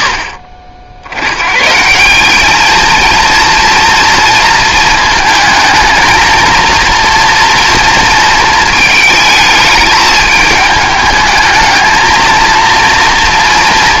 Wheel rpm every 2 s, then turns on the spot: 70, 220, 230, 230, 230, 210, 230.
none